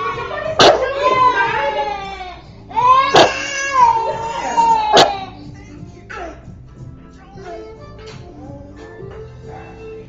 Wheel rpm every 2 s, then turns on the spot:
0, 0, 0, 0, 0.
none